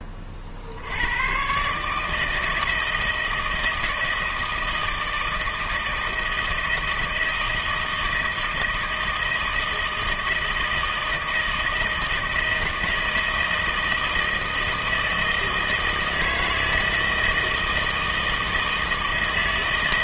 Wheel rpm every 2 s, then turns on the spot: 80, 160, 160, 160, 160, 160, 160, 160, 160, 160.
none